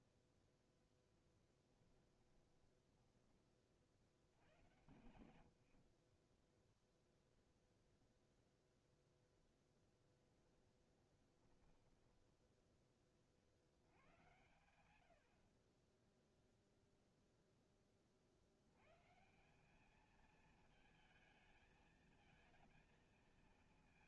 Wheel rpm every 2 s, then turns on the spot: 0, 10, 90, 0, 0, 20, 10, 80, 0, 110, 220, 220.
2-4 10-14